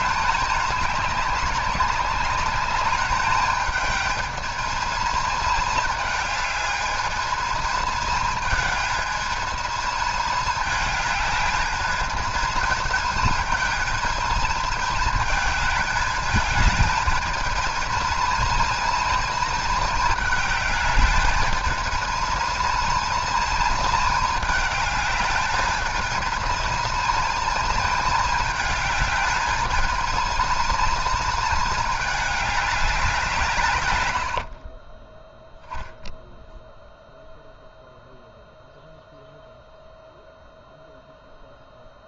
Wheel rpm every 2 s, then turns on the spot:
210, 200, 220, 220, 220, 210, 220, 220, 220, 230, 210, 220, 210, 230, 220, 230, 210, 40, 0, 0, 0.
34-36